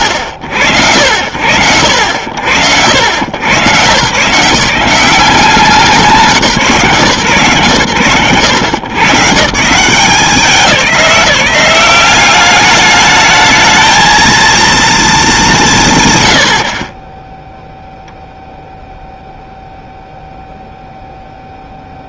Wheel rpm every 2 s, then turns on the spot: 50, 70, 160, 170, 100, 180, 200, 230, 60, 0, 0.
none